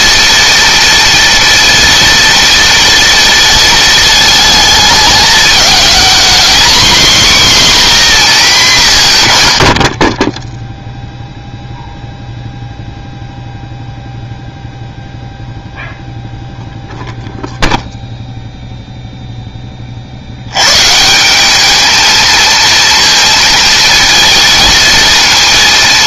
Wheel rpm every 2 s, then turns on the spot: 230, 230, 220, 250, 200, 0, 0, 0, 0, 0, 140, 230, 230.
none